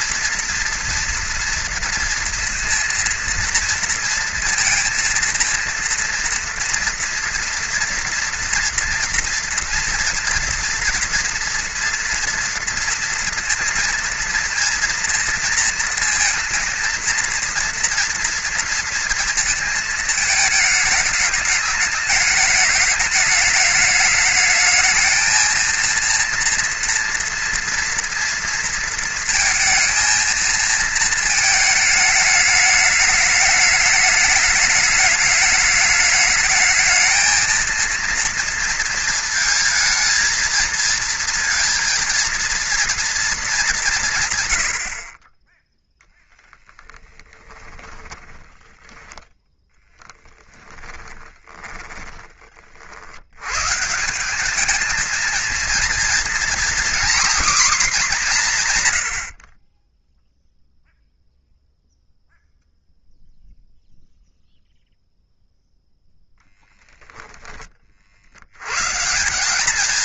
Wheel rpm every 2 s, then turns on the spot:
230, 230, 230, 230, 230, 240, 230, 230, 230, 230, 220, 210, 220, 230, 230, 230, 210, 210, 220, 230, 230, 230, 70, 10, 10, 20, 60, 220, 250, 130, 0, 0, 0, 0, 120.
50-52